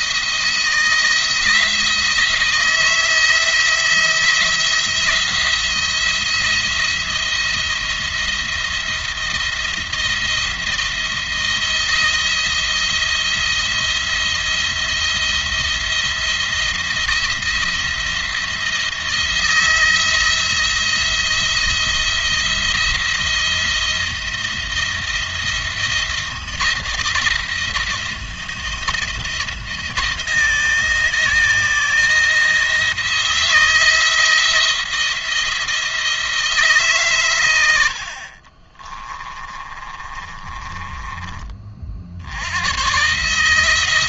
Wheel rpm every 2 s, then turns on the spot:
170, 160, 170, 170, 170, 170, 170, 170, 170, 170, 170, 170, 170, 160, 170, 160, 170, 170, 140, 30, 20, 110.
38-42